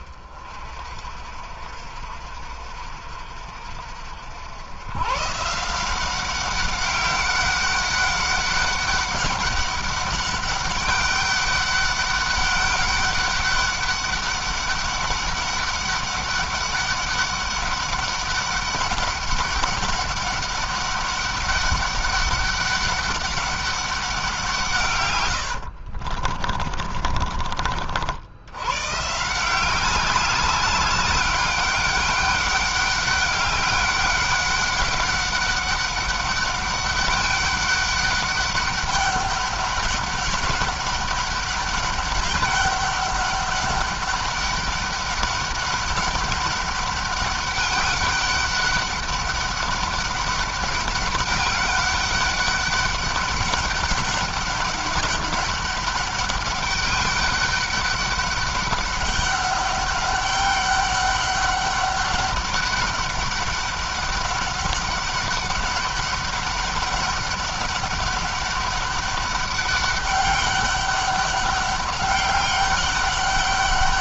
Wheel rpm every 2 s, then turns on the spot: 50, 60, 110, 200, 200, 200, 200, 200, 190, 200, 200, 200, 130, 30, 130, 200, 200, 200, 200, 200, 200, 200, 200, 200, 200, 200, 200, 200, 200, 200, 200, 200, 200, 200, 200, 200, 200.
26-28